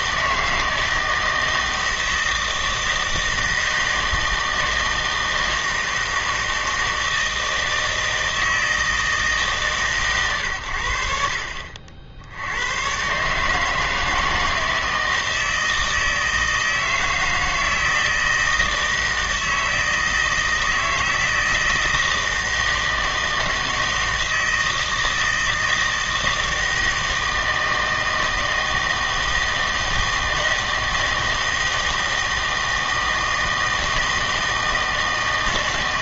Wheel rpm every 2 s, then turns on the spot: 160, 160, 160, 160, 160, 110, 100, 160, 160, 160, 160, 160, 160, 160, 160, 160, 160, 160.
none